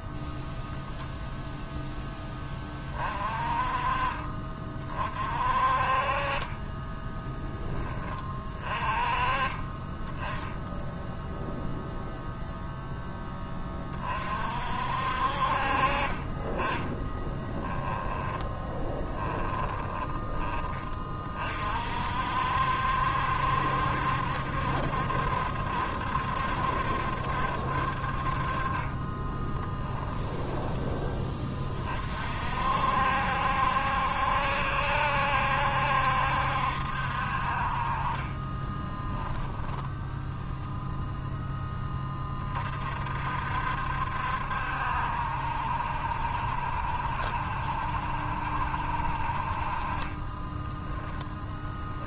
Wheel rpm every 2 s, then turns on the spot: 0, 20, 40, 20, 30, 10, 0, 50, 10, 10, 30, 60, 70, 70, 40, 10, 50, 70, 70, 30, 0, 40, 70, 70, 70, 10.
18-20 28-32 38-40 50-52